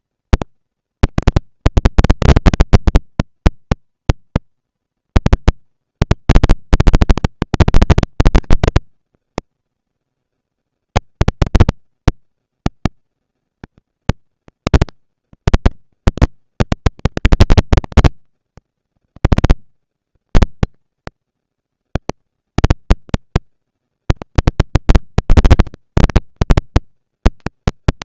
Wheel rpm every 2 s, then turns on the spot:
230, 230, 230, 230, 230, 230, 230, 230, 230, 190, 110, 160, 230, 230.
none